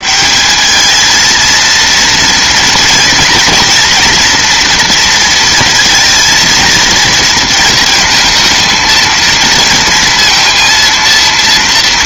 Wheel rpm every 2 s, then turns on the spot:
210, 230, 230, 230, 220, 230.
none